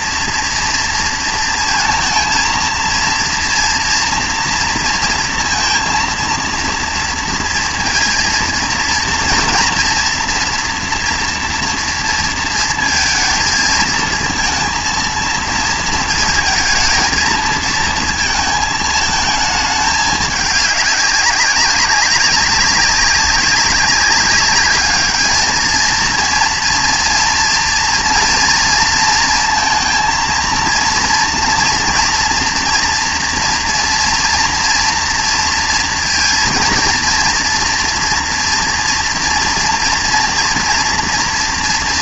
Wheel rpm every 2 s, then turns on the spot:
230, 230, 230, 230, 230, 230, 230, 230, 220, 220, 200, 200, 210, 230, 230, 230, 230, 230, 230, 230, 240.
none